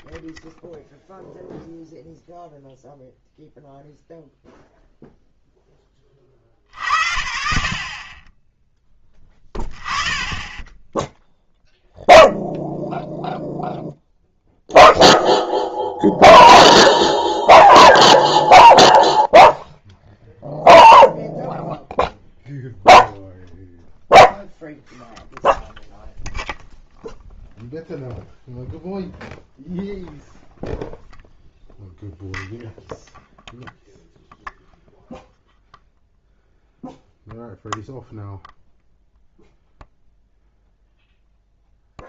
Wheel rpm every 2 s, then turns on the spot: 0, 0, 0, 70, 10, 10, 0, 0, 0, 0, 0, 0, 0, 0, 0, 0, 0, 0, 0, 0, 0.
none